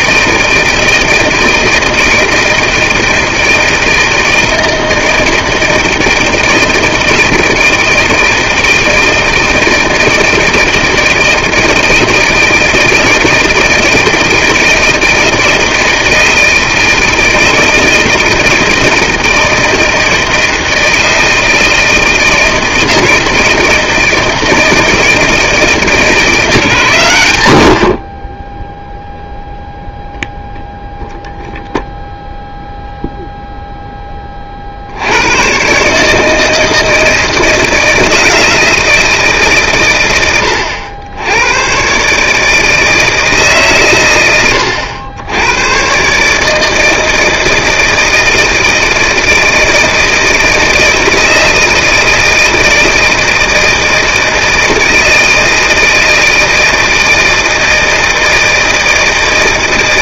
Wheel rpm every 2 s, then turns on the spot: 160, 160, 160, 160, 160, 170, 160, 160, 160, 160, 160, 160, 160, 110, 0, 0, 0, 120, 160, 150, 110, 140, 110, 160, 160, 160, 160, 160, 160, 160.
none